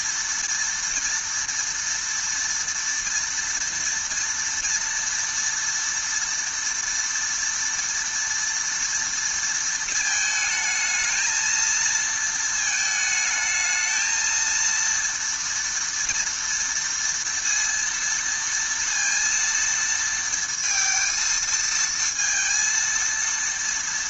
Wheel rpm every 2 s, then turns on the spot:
240, 230, 230, 230, 230, 220, 220, 230, 230, 230, 230, 230.
none